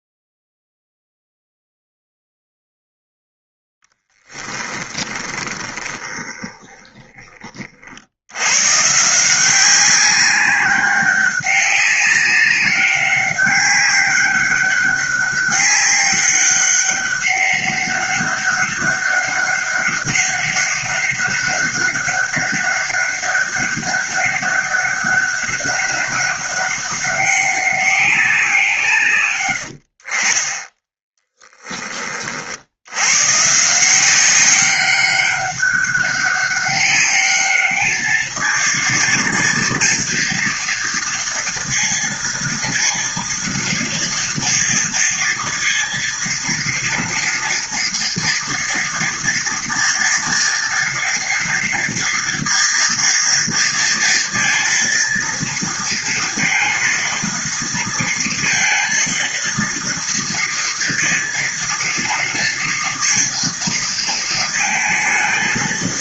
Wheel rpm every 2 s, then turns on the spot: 0, 0, 10, 20, 110, 190, 200, 200, 200, 200, 200, 200, 200, 200, 170, 20, 60, 190, 200, 220, 230, 230, 230, 230, 230, 230, 230, 230, 230, 230, 230, 230, 230.
4-8